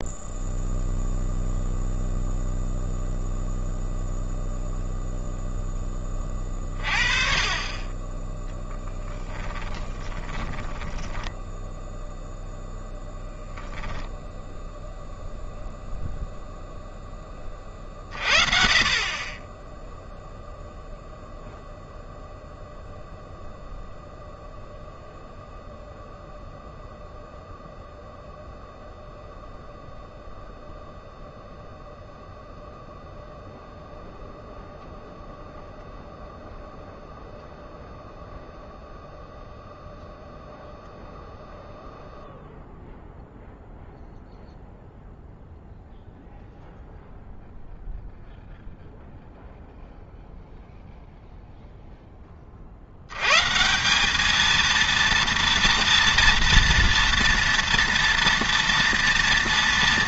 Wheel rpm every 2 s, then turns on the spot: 0, 0, 0, 30, 0, 10, 0, 0, 0, 40, 0, 0, 0, 0, 0, 0, 0, 0, 0, 0, 0, 0, 0, 0, 0, 0, 60, 230, 230, 230.
10-12